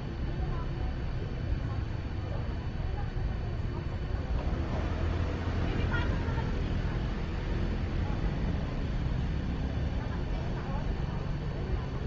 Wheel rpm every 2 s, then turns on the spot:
0, 0, 0, 0, 0, 0.
none